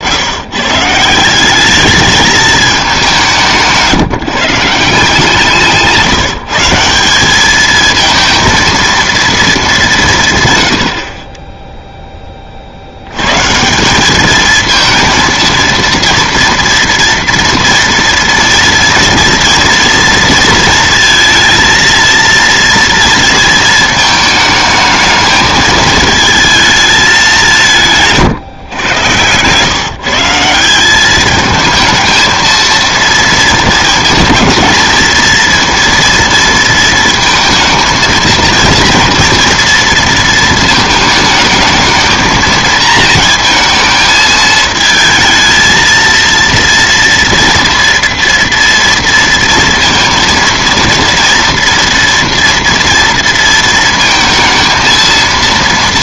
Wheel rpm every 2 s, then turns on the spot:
150, 210, 160, 160, 230, 90, 60, 220, 230, 230, 230, 230, 220, 220, 130, 180, 230, 230, 230, 230, 220, 220, 220, 230, 230, 230, 230, 220.
none